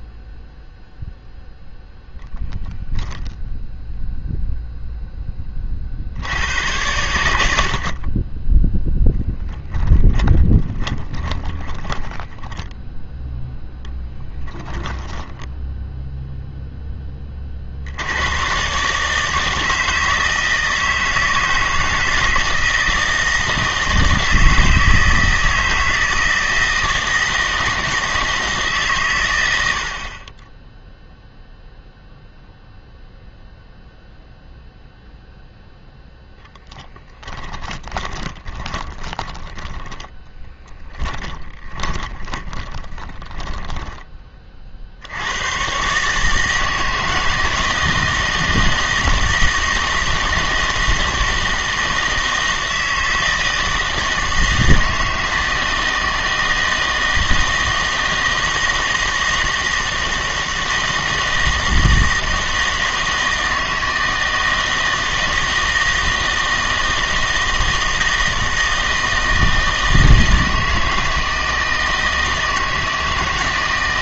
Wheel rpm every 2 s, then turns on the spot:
0, 0, 0, 90, 10, 10, 0, 10, 10, 140, 160, 160, 160, 160, 150, 10, 0, 0, 10, 20, 10, 10, 50, 160, 160, 160, 160, 160, 160, 160, 160, 160, 160, 160, 160, 160, 160.
10-12 14-16 36-44